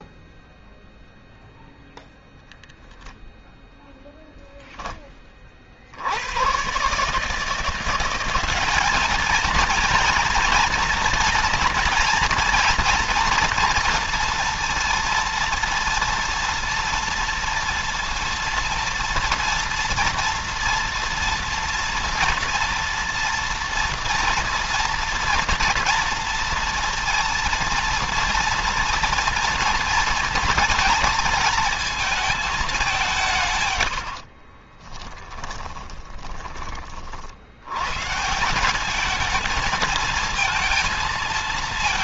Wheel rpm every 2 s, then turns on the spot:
0, 0, 0, 80, 180, 230, 230, 230, 230, 230, 240, 230, 230, 230, 230, 230, 220, 50, 20, 150, 230.
34-36